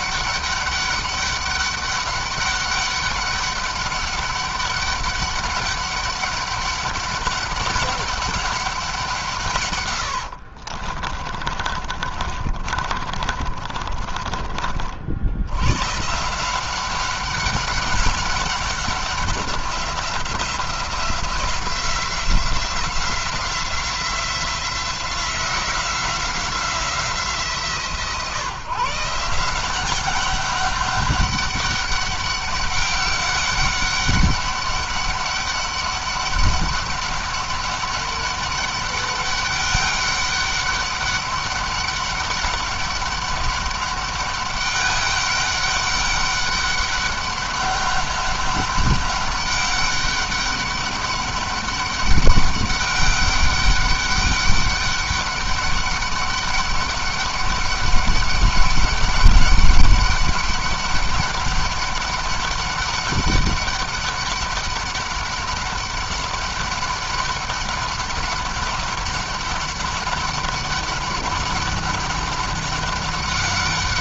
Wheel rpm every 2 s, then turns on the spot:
200, 190, 200, 200, 180, 50, 40, 50, 190, 200, 180, 180, 180, 170, 150, 200, 200, 200, 200, 200, 200, 200, 200, 200, 200, 200, 200, 200, 200, 200, 200, 200, 200, 200, 200, 200, 200.
10-14